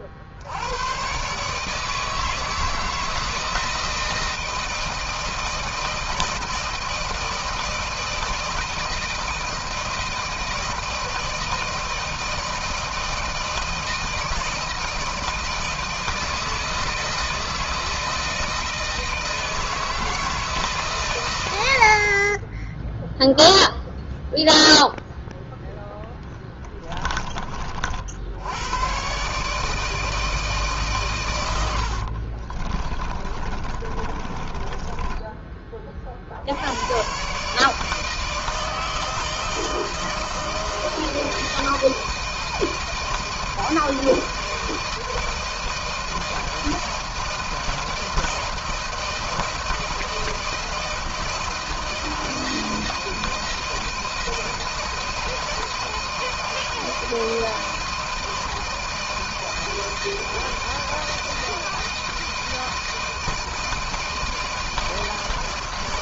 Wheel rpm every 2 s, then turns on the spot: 60, 160, 160, 160, 160, 160, 160, 160, 160, 160, 160, 40, 0, 10, 70, 160, 50, 30, 50, 160, 160, 160, 160, 160, 170, 170, 160, 160, 160, 160, 160, 160, 160.
26-28 32-36